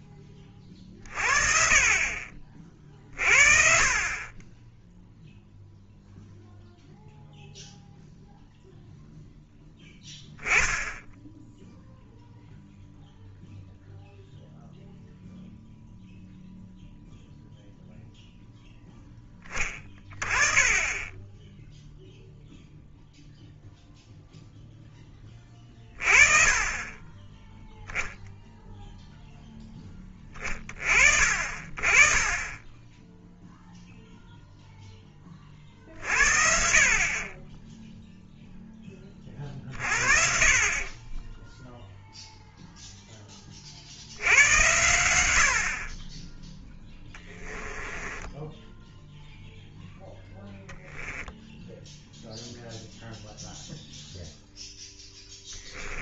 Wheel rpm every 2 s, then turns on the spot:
40, 40, 0, 0, 0, 10, 0, 0, 0, 0, 20, 0, 10, 30, 0, 30, 10, 0, 50, 10, 30, 0, 90, 10, 0, 10, 0, 0.
46-48 50-52